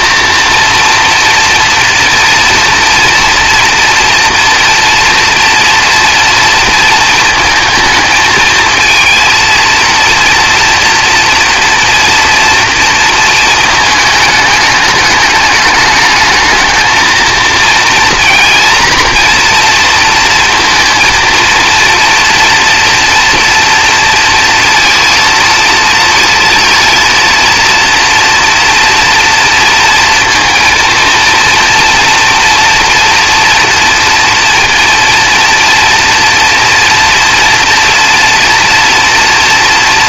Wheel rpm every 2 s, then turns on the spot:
230, 240, 240, 230, 220, 230, 230, 210, 220, 230, 230, 230, 230, 230, 230, 230, 230, 230, 240, 230.
none